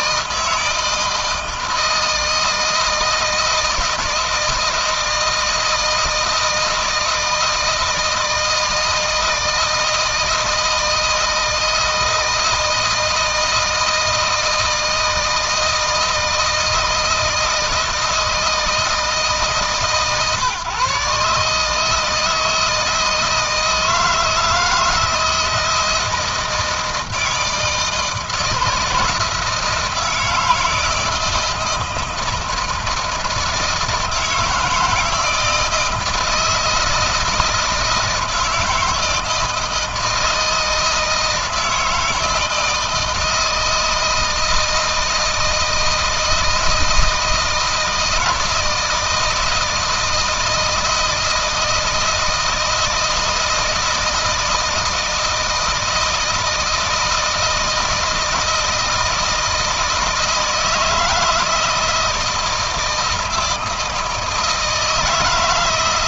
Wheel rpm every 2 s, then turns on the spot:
160, 160, 160, 160, 160, 160, 160, 160, 160, 160, 140, 160, 170, 160, 160, 160, 160, 160, 160, 160, 160, 160, 160, 160, 160, 160, 160, 160, 160, 160, 160, 170, 160.
none